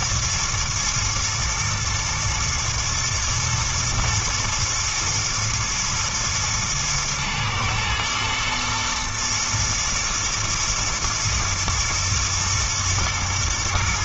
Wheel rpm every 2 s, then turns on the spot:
110, 110, 110, 110, 110, 110, 110.
none